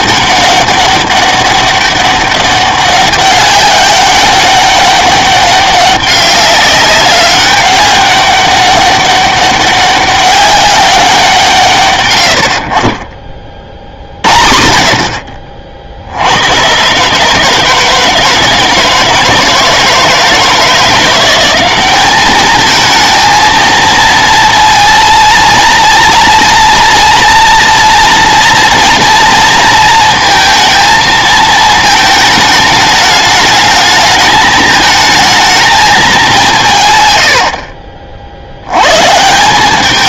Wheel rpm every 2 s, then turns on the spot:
200, 200, 200, 200, 200, 200, 50, 60, 120, 160, 170, 220, 230, 230, 230, 230, 210, 220, 160, 110.
none